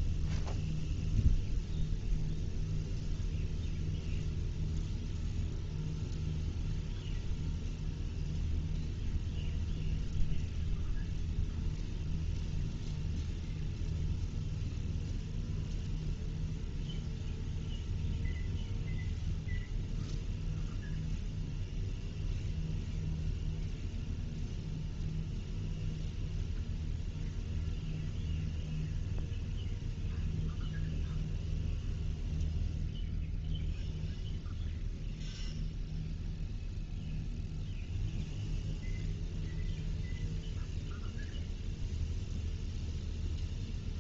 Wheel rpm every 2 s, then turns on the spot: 0, 0, 0, 0, 0, 0, 0, 0, 0, 0, 0, 0, 0, 0, 0, 0, 0, 0, 0, 0, 0, 0.
none